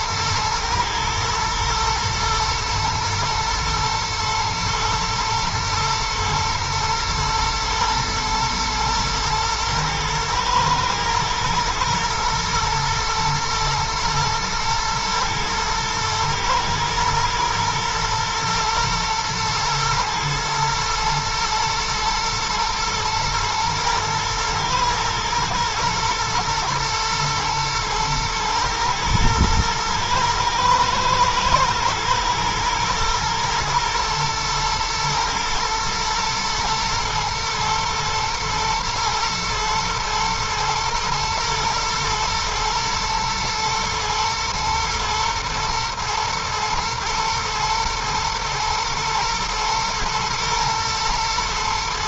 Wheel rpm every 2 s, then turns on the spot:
110, 120, 110, 110, 120, 110, 110, 110, 110, 120, 110, 120, 120, 120, 110, 110, 120, 120, 120, 110, 110, 110, 110, 120, 120, 120.
none